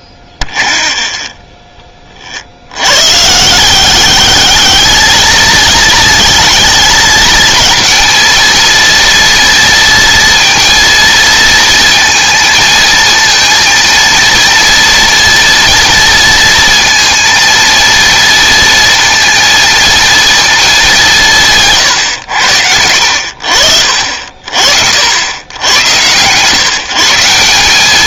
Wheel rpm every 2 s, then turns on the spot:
30, 90, 220, 220, 230, 230, 220, 230, 230, 230, 220, 90, 60, 150.
0-2